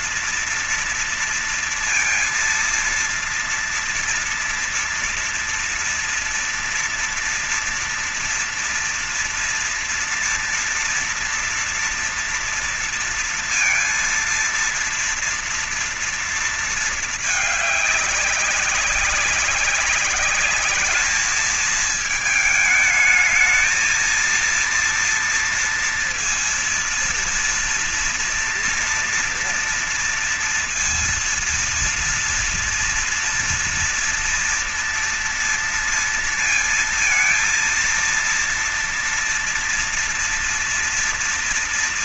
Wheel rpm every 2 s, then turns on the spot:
230, 230, 230, 240, 230, 240, 230, 230, 230, 200, 200, 220, 230, 230, 230, 230, 230, 230, 230, 230, 230.
none